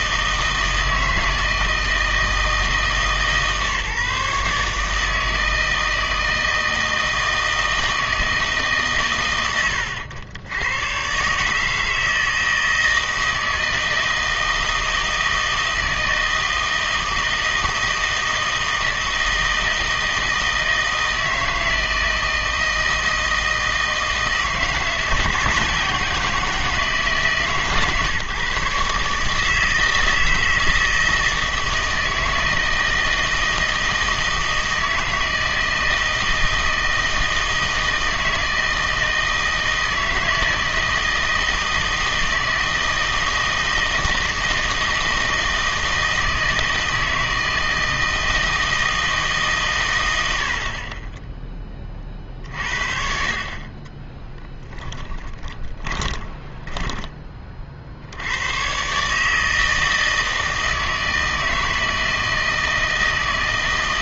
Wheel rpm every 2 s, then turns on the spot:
160, 160, 150, 160, 150, 100, 160, 160, 160, 160, 160, 160, 160, 170, 140, 160, 160, 160, 160, 160, 160, 160, 160, 160, 160, 50, 50, 20, 20, 120, 160, 160.
50-52 54-58